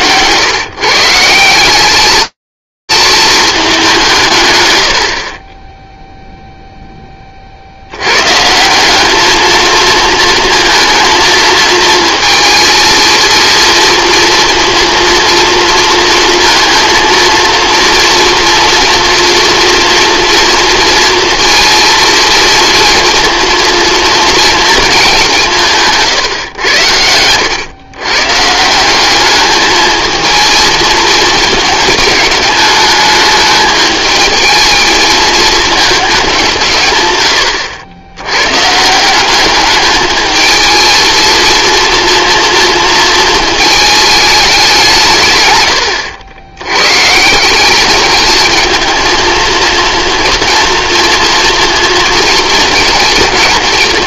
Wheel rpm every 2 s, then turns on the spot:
130, 220, 40, 30, 210, 230, 230, 230, 230, 230, 230, 230, 210, 90, 200, 220, 210, 220, 120, 170, 230, 230, 150, 150, 230, 230, 230.
none